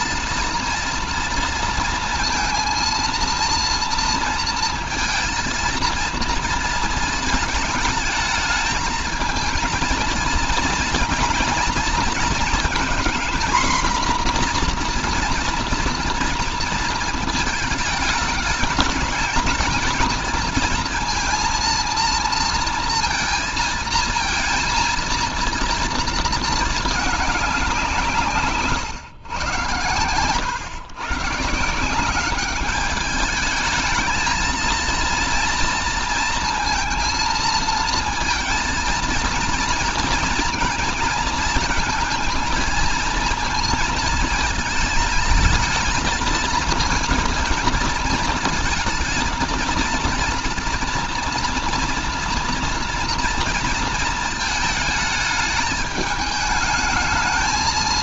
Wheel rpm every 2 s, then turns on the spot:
230, 230, 230, 230, 220, 230, 230, 240, 230, 210, 230, 230, 230, 220, 130, 110, 200, 220, 230, 230, 230, 230, 220, 230, 230, 230, 230, 220, 220.
none